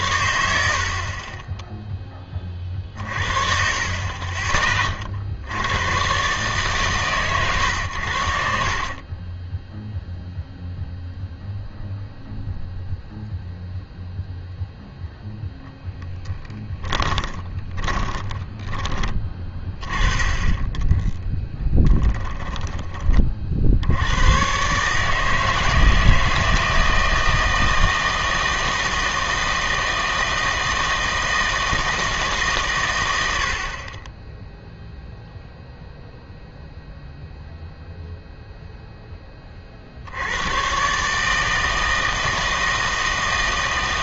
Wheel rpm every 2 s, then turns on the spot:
60, 40, 30, 140, 50, 0, 0, 0, 10, 20, 20, 20, 130, 160, 160, 160, 140, 0, 0, 0, 110, 160.
2-4 8-10 16-18 20-22